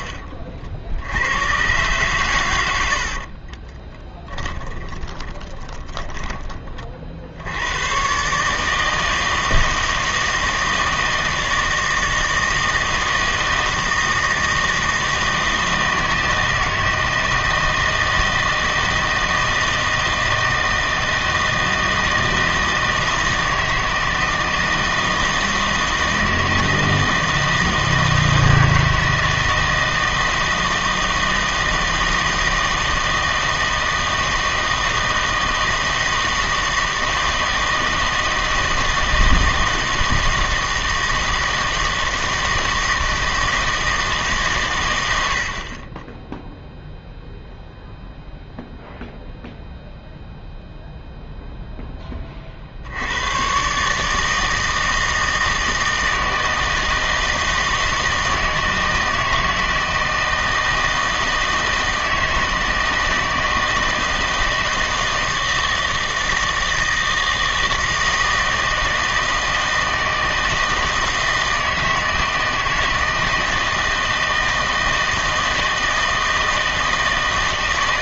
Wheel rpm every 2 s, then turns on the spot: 50, 100, 10, 20, 150, 160, 160, 160, 160, 160, 160, 160, 160, 160, 160, 160, 160, 160, 160, 160, 160, 160, 130, 0, 0, 0, 40, 160, 160, 160, 160, 160, 160, 160, 160, 160, 160, 160, 160.
4-6